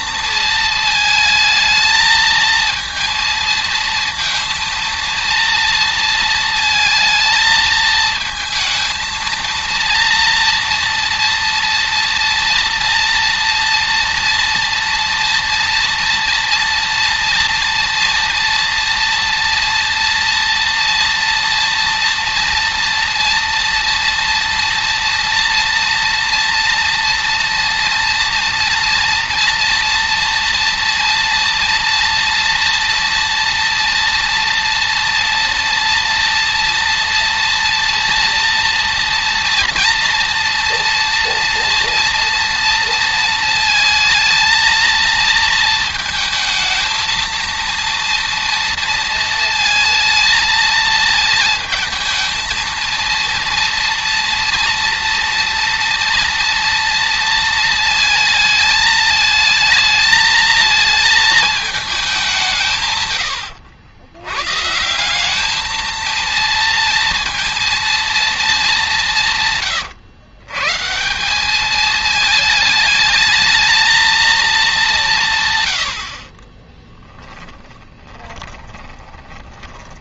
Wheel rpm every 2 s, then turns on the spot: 220, 230, 230, 230, 220, 230, 230, 230, 230, 240, 230, 230, 240, 230, 230, 230, 240, 230, 230, 240, 240, 230, 220, 230, 230, 220, 220, 230, 230, 220, 220, 160, 150, 230, 200, 150, 220, 200, 20, 20.
76-80